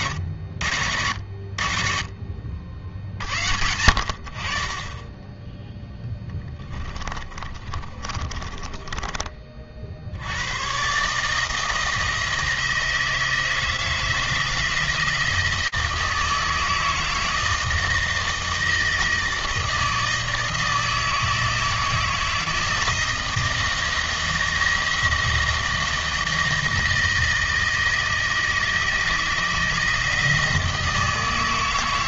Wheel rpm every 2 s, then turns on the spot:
70, 70, 30, 20, 30, 130, 160, 160, 160, 160, 160, 160, 170, 160, 160, 160.
6-8